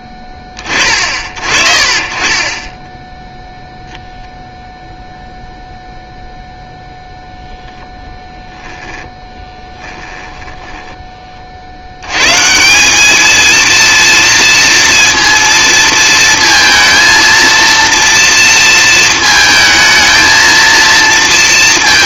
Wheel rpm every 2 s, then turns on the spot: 30, 10, 0, 0, 10, 10, 170, 230, 230, 230, 230.
8-10